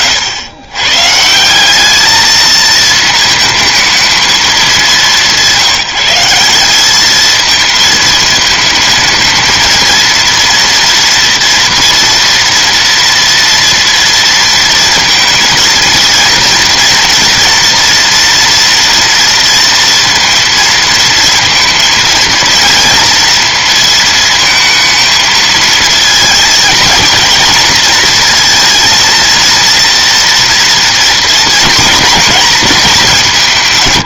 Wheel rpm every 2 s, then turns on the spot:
110, 220, 210, 200, 220, 230, 240, 230, 230, 230, 230, 230, 230, 230, 230, 230, 220.
none